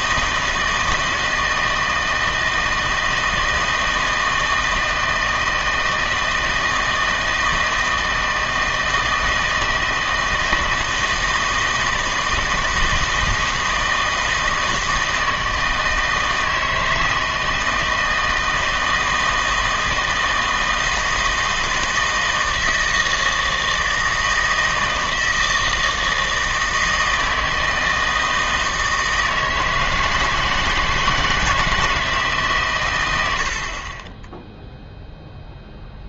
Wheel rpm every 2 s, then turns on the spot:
160, 160, 160, 160, 160, 160, 160, 160, 160, 160, 160, 160, 160, 160, 160, 160, 130, 0.
none